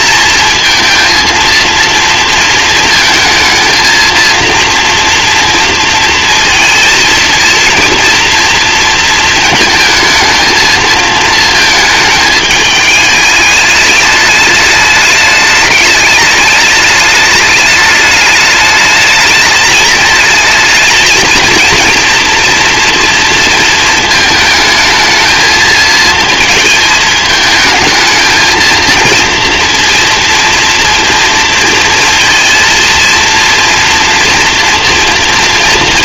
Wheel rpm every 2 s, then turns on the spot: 230, 230, 230, 230, 230, 220, 210, 210, 210, 210, 220, 230, 220, 220, 230, 230, 230, 230.
none